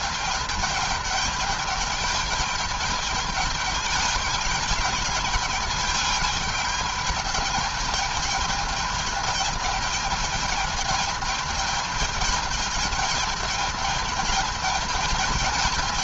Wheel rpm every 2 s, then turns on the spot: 210, 210, 210, 220, 210, 220, 220, 210.
none